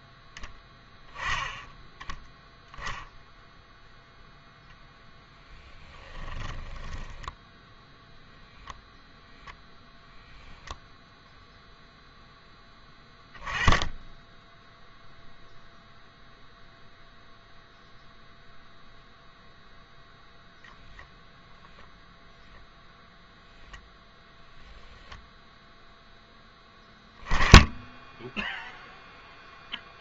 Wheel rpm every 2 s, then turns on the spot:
10, 0, 0, 10, 0, 0, 10, 0, 0, 0, 0, 0, 10, 10, 0.
6-8